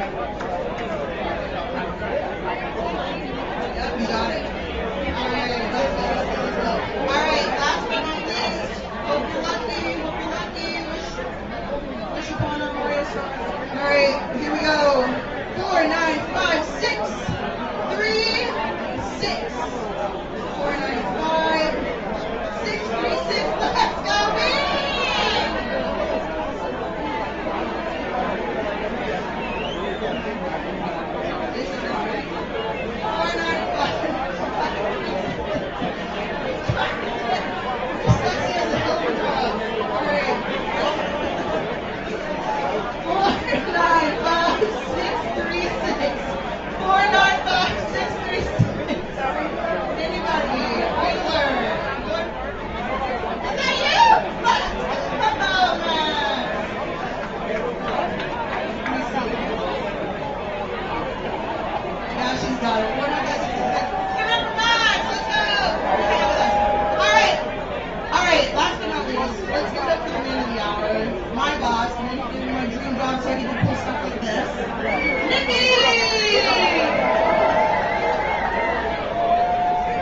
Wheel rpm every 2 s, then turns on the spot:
0, 0, 0, 0, 0, 0, 0, 0, 0, 0, 0, 0, 0, 0, 0, 0, 0, 0, 0, 0, 0, 0, 0, 0, 0, 0, 0, 0, 0, 0, 0, 0, 0, 0, 0, 0, 0, 0, 0, 0.
none